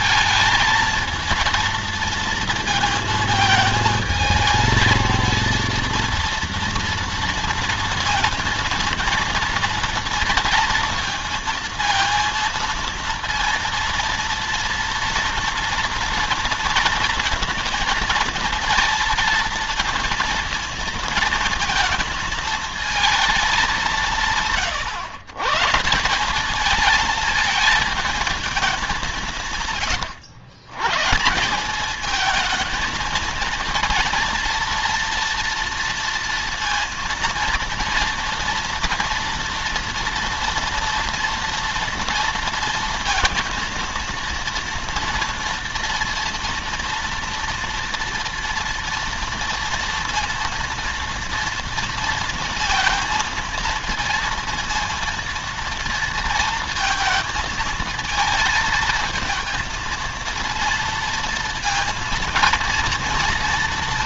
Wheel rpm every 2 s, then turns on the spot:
220, 230, 230, 230, 230, 230, 230, 230, 230, 230, 230, 230, 120, 220, 200, 120, 230, 230, 230, 230, 230, 230, 230, 230, 230, 230, 230, 230, 230, 220, 230, 230.
none